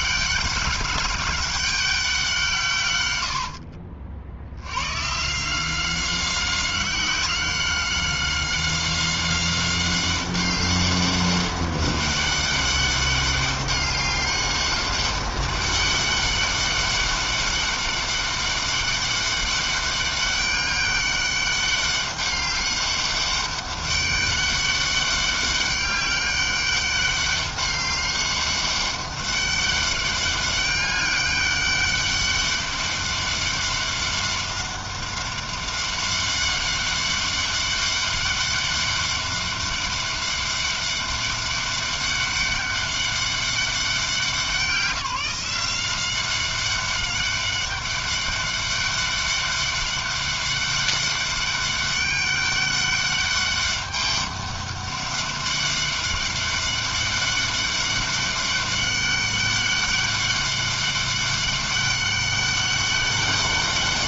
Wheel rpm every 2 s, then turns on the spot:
200, 160, 90, 190, 190, 200, 200, 200, 200, 200, 200, 200, 200, 200, 200, 200, 200, 200, 200, 200, 200, 200, 180, 190, 200, 200, 200, 200, 200, 200, 200, 200.
none